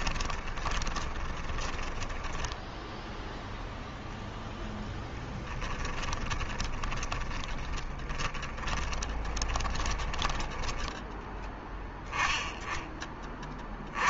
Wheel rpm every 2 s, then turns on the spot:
20, 0, 0, 20, 20, 10, 20.
0-2 6-10